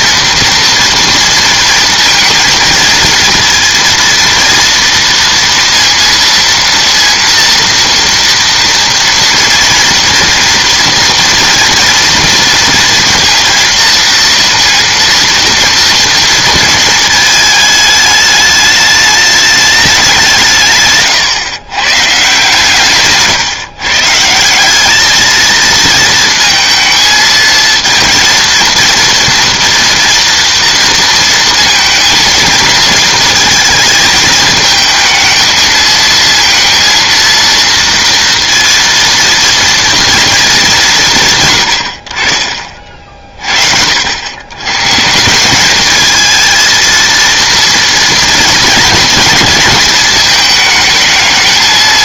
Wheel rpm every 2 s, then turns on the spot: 240, 230, 230, 230, 230, 230, 230, 230, 220, 210, 140, 140, 190, 220, 230, 230, 230, 220, 230, 230, 200, 40, 110, 230, 230, 220.
none